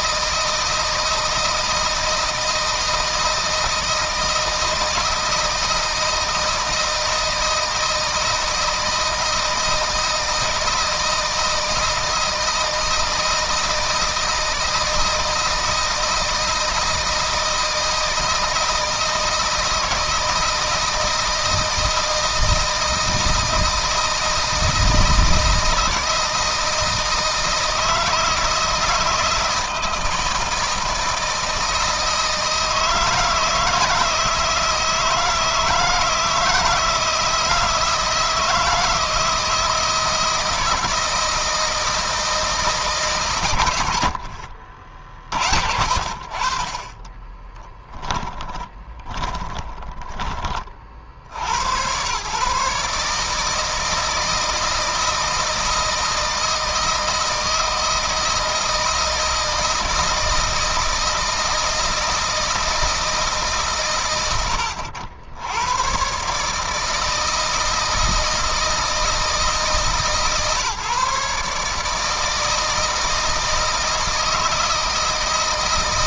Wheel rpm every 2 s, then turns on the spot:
160, 160, 160, 160, 160, 160, 160, 160, 160, 160, 160, 160, 160, 160, 160, 160, 160, 160, 170, 160, 170, 160, 50, 40, 10, 40, 140, 160, 160, 160, 160, 160, 90, 150, 160, 140, 160, 160.
46-50